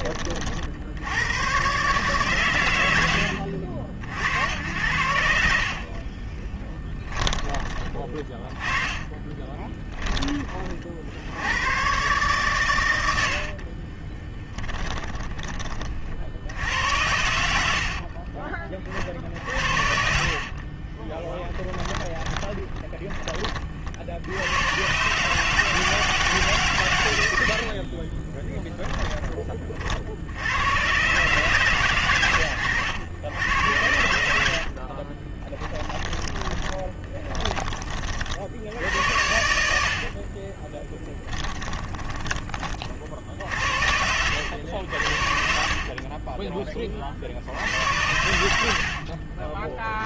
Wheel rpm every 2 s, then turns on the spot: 80, 80, 90, 20, 20, 60, 100, 10, 80, 40, 20, 30, 120, 120, 10, 120, 90, 60, 20, 70, 30, 40, 90, 20, 70.
8-10 14-16 20-24 28-30 34-38 40-42 44-46